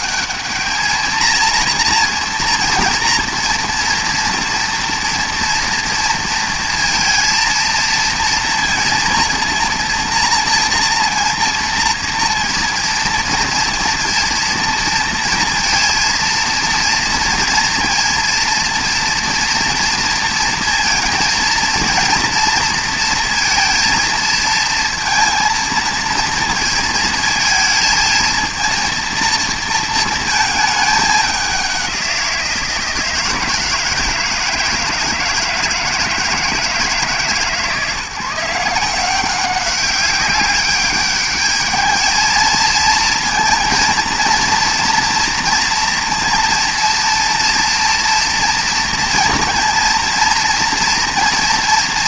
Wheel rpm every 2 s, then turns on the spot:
220, 230, 230, 230, 230, 230, 230, 230, 230, 230, 230, 230, 230, 220, 230, 210, 170, 160, 160, 180, 200, 230, 230, 240, 230, 230.
none